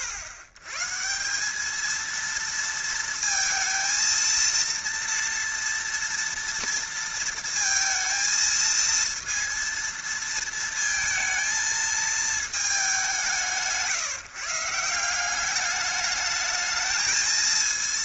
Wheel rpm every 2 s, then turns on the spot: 110, 230, 230, 230, 220, 230, 210, 170, 220.
none